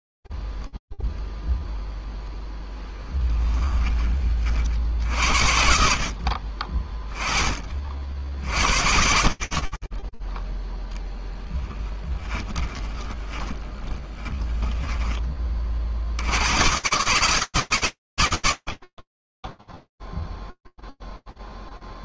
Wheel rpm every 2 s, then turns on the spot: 0, 0, 10, 60, 20, 40, 20, 30, 60, 80, 0.
4-6 12-16